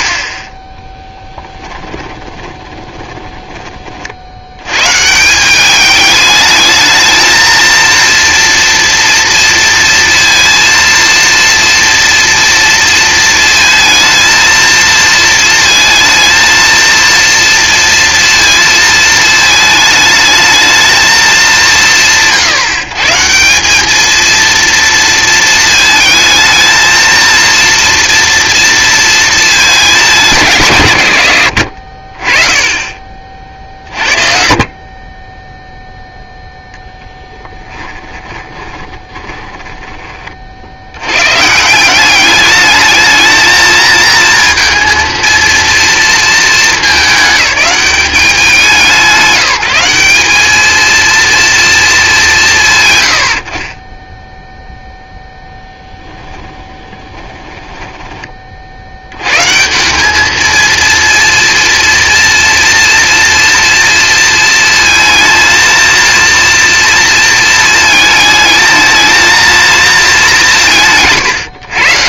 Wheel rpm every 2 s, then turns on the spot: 10, 20, 100, 220, 230, 230, 230, 230, 230, 230, 220, 160, 230, 220, 230, 160, 20, 40, 0, 20, 60, 210, 230, 220, 170, 220, 110, 0, 20, 50, 220, 230, 230, 230, 220, 190.
2-4 38-40 56-58